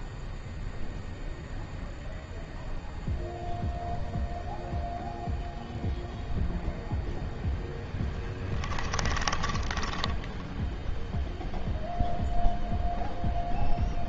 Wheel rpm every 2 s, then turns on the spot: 0, 0, 0, 0, 10, 0, 0.
8-10